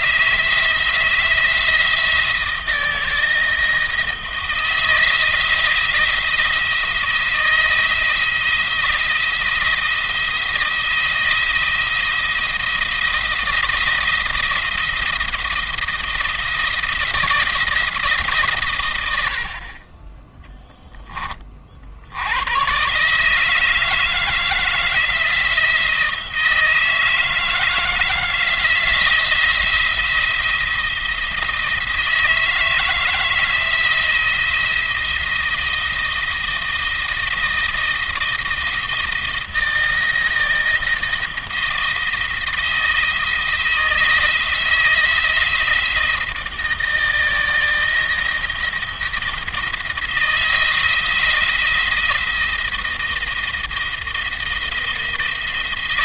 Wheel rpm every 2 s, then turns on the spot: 170, 160, 170, 160, 170, 160, 170, 170, 170, 90, 10, 130, 160, 160, 170, 170, 160, 170, 160, 170, 160, 170, 160, 160, 170, 160, 170, 170.
none